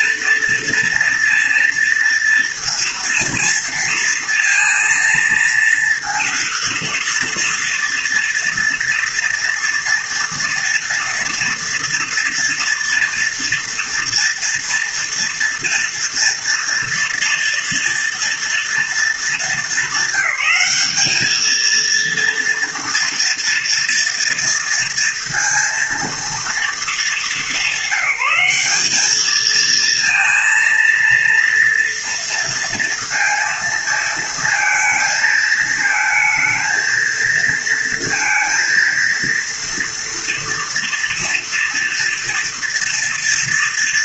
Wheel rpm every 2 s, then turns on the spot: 230, 230, 230, 230, 230, 240, 230, 230, 230, 220, 210, 230, 230, 220, 210, 230, 230, 220, 220, 230, 230, 230.
none